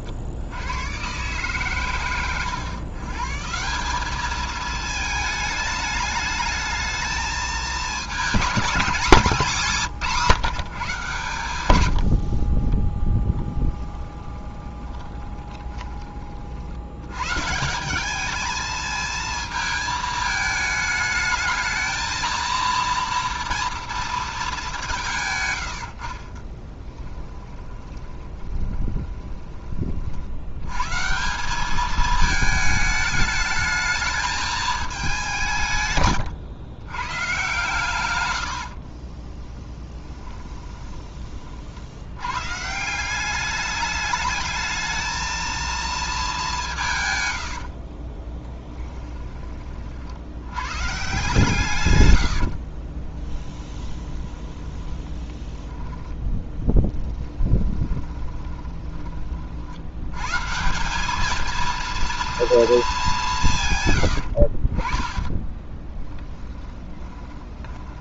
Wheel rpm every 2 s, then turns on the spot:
90, 120, 220, 220, 210, 150, 30, 20, 60, 220, 220, 230, 190, 10, 20, 110, 210, 220, 120, 80, 20, 150, 220, 180, 10, 130, 60, 10, 10, 20, 170, 220, 40, 10.
12-16 26-30 38-42 48-50 52-60 64-68